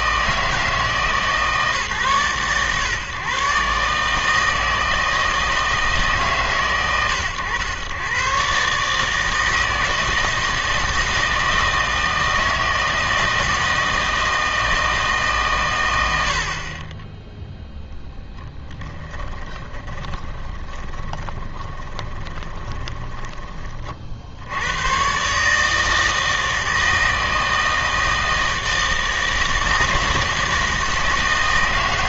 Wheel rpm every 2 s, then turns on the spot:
160, 120, 160, 120, 140, 160, 160, 160, 30, 10, 20, 20, 90, 160, 160, 160.
18-24